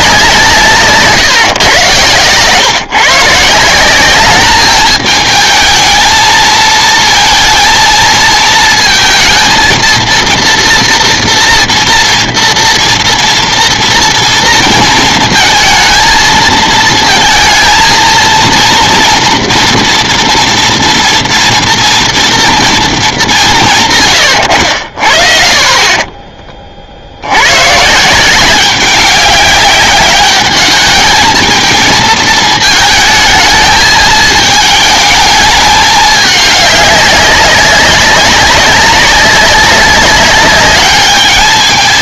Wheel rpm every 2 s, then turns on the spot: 160, 130, 210, 220, 230, 230, 230, 230, 230, 230, 230, 230, 80, 30, 190, 210, 220, 220, 200, 190, 200.
none